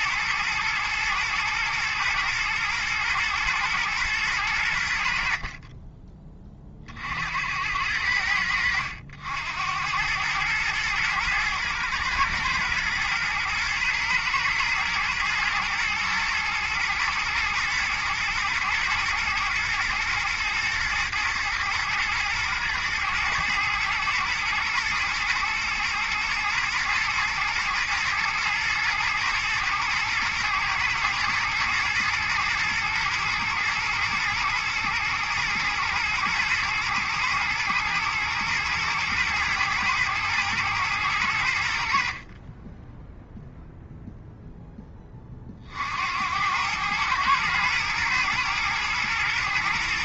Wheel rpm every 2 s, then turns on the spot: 110, 110, 70, 50, 90, 110, 120, 110, 110, 110, 120, 110, 110, 120, 120, 110, 110, 110, 110, 120, 110, 10, 20, 110, 110.
none